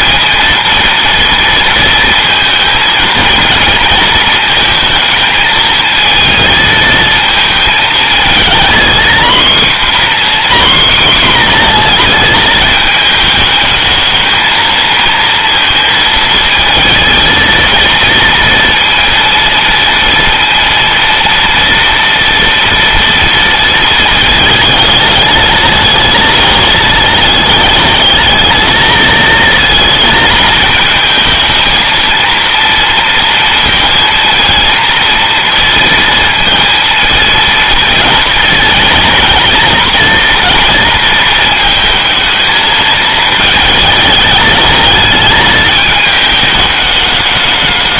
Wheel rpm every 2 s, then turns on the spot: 230, 220, 220, 220, 240, 250, 220, 230, 220, 230, 230, 230, 210, 210, 220, 220, 230, 230, 230, 230, 230, 220, 210, 210.
none